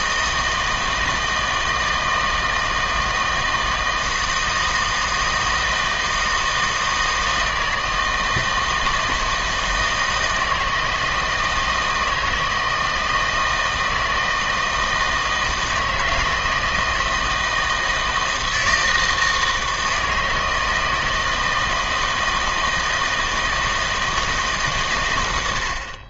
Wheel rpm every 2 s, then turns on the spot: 160, 160, 160, 160, 160, 160, 160, 160, 160, 160, 160, 160, 130.
none